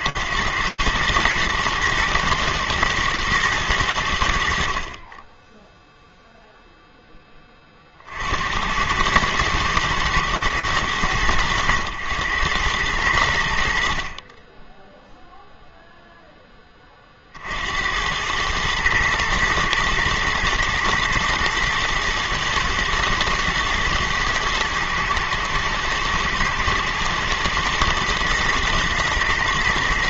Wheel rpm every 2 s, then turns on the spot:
110, 110, 50, 10, 100, 90, 100, 0, 60, 120, 120, 110, 120, 110, 120.
none